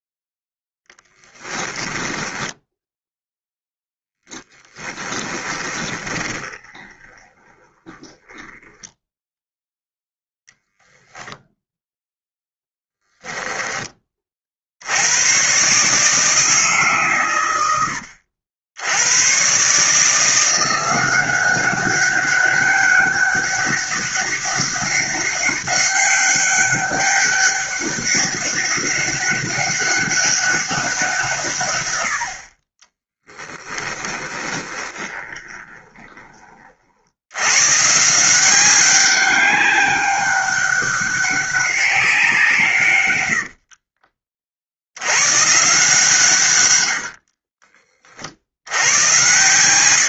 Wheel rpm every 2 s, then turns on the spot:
10, 10, 20, 20, 10, 0, 10, 70, 140, 80, 180, 200, 200, 200, 200, 190, 30, 20, 60, 190, 190, 130, 80, 90, 80.
0-10 34-36 46-48